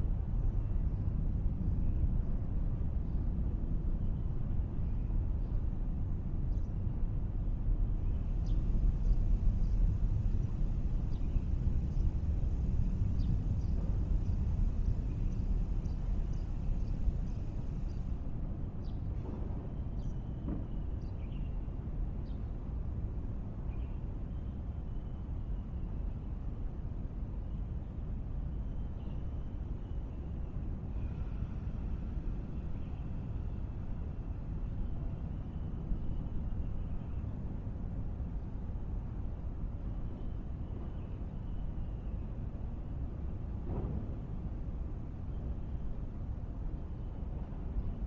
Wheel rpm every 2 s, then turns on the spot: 0, 0, 0, 0, 0, 0, 0, 0, 0, 0, 0, 0, 0, 0, 0, 0, 0, 0, 0, 0, 0, 0, 0, 0.
none